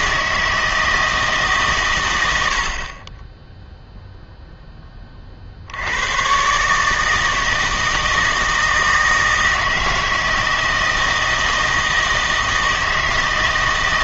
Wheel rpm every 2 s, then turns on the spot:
160, 60, 10, 150, 160, 160, 160.
none